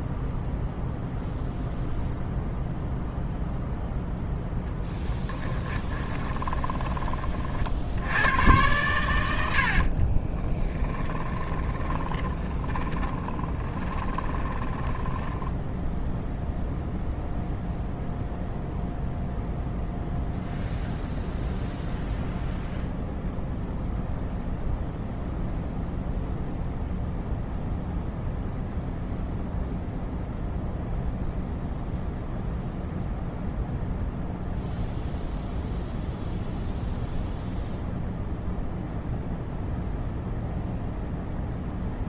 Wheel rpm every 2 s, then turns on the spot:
0, 0, 10, 20, 110, 20, 10, 20, 0, 0, 0, 0, 0, 0, 0, 0, 0, 0, 0, 0, 0.
4-8 10-16